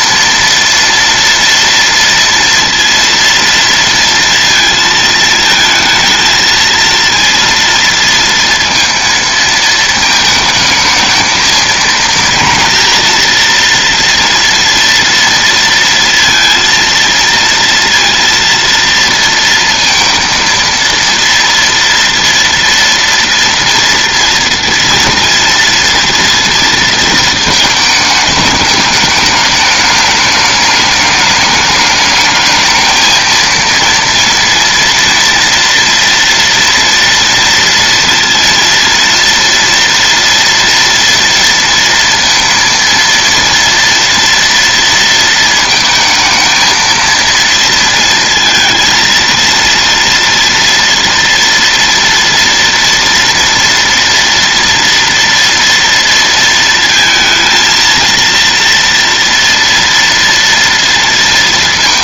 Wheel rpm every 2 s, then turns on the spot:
230, 230, 230, 230, 230, 220, 230, 230, 230, 230, 230, 230, 230, 230, 210, 210, 220, 230, 230, 230, 230, 230, 230, 230, 230, 230, 230, 230, 230, 230, 230.
none